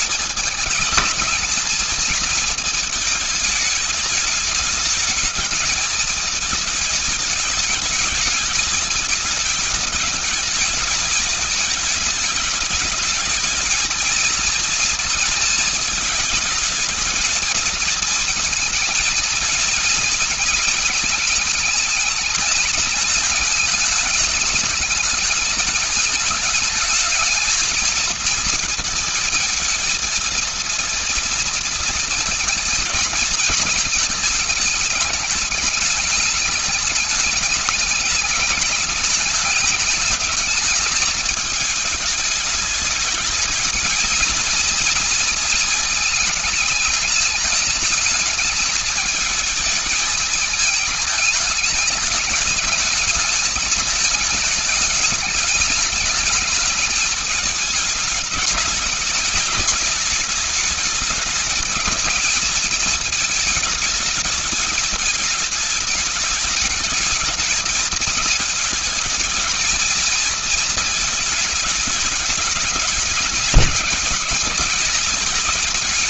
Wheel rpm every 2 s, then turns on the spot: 220, 220, 210, 210, 210, 210, 210, 230, 220, 220, 220, 210, 210, 210, 230, 230, 220, 220, 210, 210, 210, 210, 220, 220, 210, 220, 210, 220, 220, 220, 210, 220, 210, 210, 220, 220, 220, 210.
none